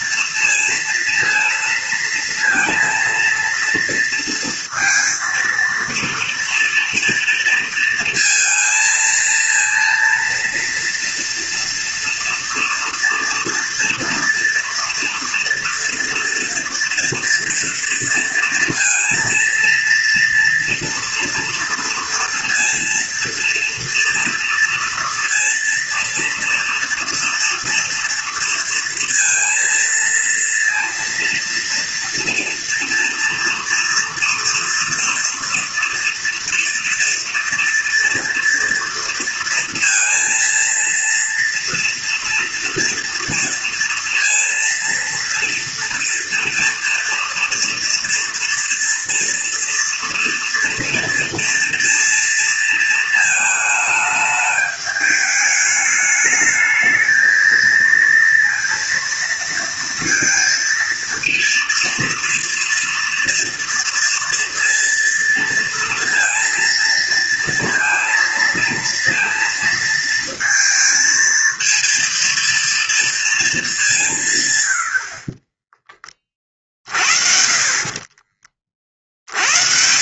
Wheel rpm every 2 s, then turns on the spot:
230, 230, 230, 230, 220, 230, 230, 240, 230, 230, 240, 230, 230, 230, 230, 230, 230, 230, 230, 230, 230, 230, 230, 230, 230, 230, 220, 210, 220, 230, 230, 230, 230, 230, 230, 230, 230, 130, 40, 40.
none